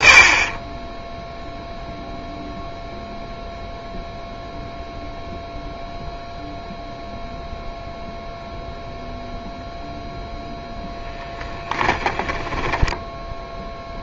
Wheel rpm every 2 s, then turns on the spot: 30, 0, 0, 0, 0, 0, 10.
12-14